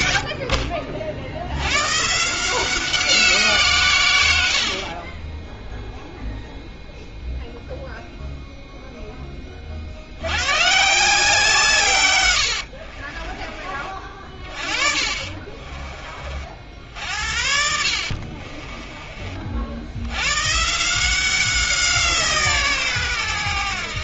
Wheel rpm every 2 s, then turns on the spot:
70, 170, 70, 0, 0, 120, 90, 40, 50, 30, 140, 140.
4-6 12-16 18-20